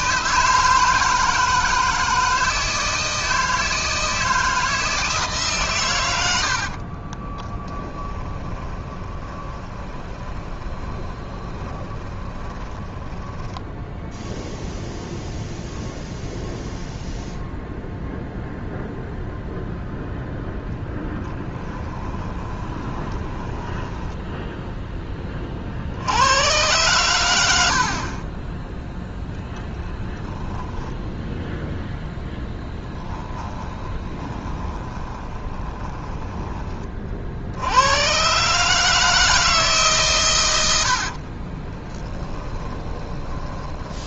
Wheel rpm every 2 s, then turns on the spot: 160, 160, 160, 50, 20, 20, 10, 0, 0, 0, 10, 20, 10, 110, 0, 0, 10, 20, 40, 150, 80, 20.
6-14 20-24 32-36 40-44